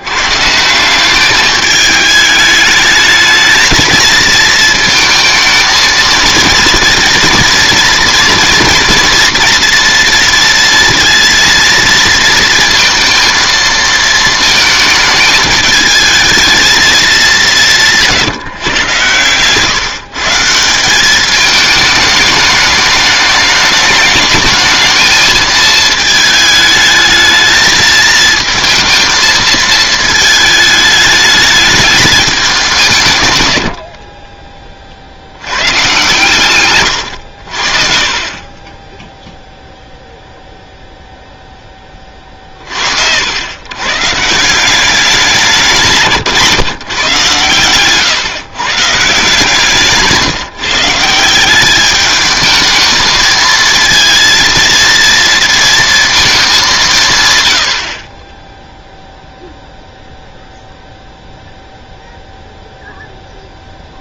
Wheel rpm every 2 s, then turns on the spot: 150, 210, 230, 230, 230, 230, 230, 220, 220, 140, 170, 210, 210, 220, 220, 220, 190, 20, 120, 30, 0, 40, 170, 150, 150, 160, 220, 230, 200, 10, 0, 0.
none